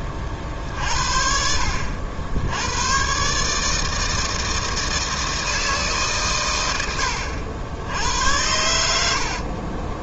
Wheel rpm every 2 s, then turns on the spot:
50, 100, 160, 100, 80.
none